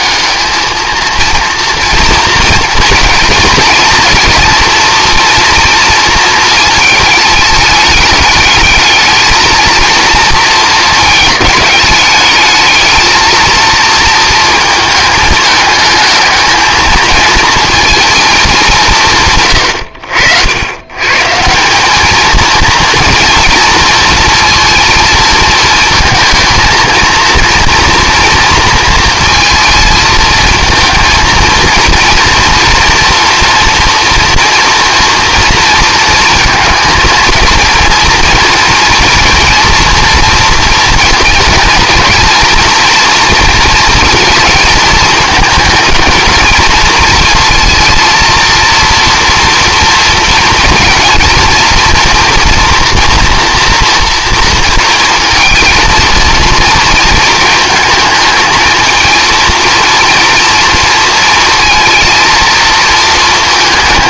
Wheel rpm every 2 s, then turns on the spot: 230, 230, 230, 220, 220, 220, 220, 220, 220, 160, 100, 230, 230, 220, 230, 220, 240, 230, 230, 230, 230, 230, 220, 230, 230, 230, 240, 230, 230, 230, 230, 230.
none